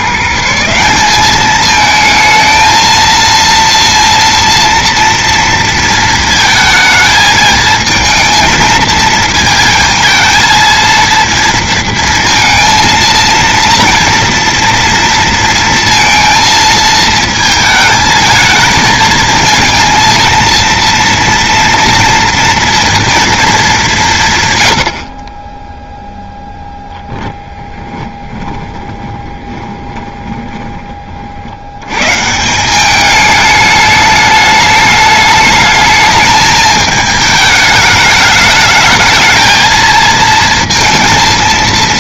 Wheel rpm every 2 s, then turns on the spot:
170, 230, 230, 220, 220, 230, 230, 230, 230, 220, 230, 230, 110, 0, 20, 20, 170, 210, 220, 210, 230.
28-30